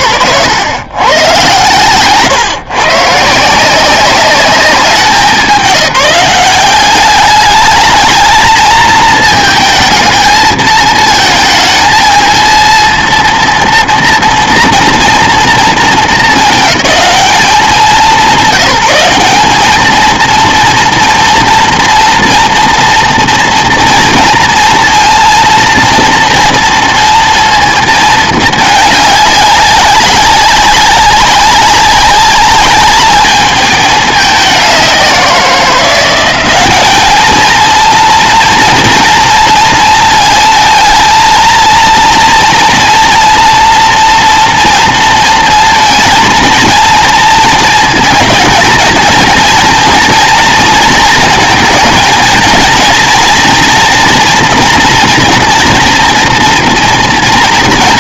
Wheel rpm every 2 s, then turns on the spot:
120, 130, 200, 190, 220, 220, 230, 230, 210, 180, 230, 230, 230, 230, 210, 200, 200, 190, 200, 230, 220, 240, 230, 230, 230, 230, 230, 230, 240.
none